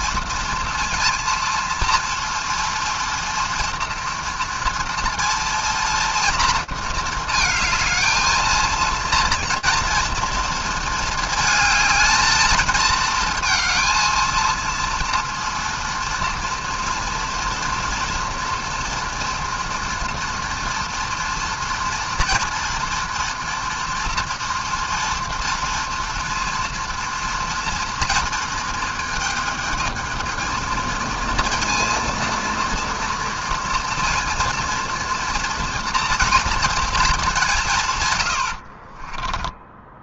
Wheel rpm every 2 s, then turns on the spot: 230, 230, 230, 230, 220, 230, 220, 230, 230, 230, 240, 230, 230, 230, 230, 220, 230, 240, 230, 100.
38-40